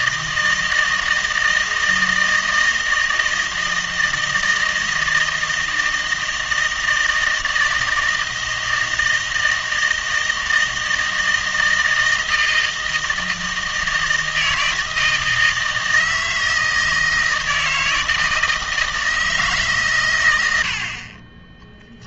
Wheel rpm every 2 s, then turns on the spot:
160, 160, 160, 160, 160, 160, 160, 160, 160, 160, 90.
none